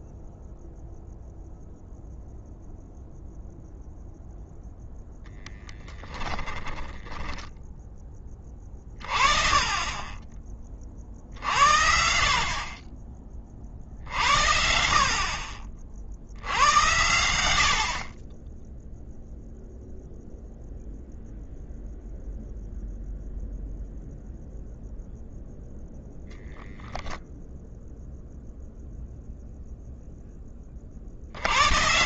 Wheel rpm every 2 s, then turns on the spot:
0, 0, 0, 10, 20, 40, 30, 50, 90, 10, 0, 0, 0, 0, 0, 40.
none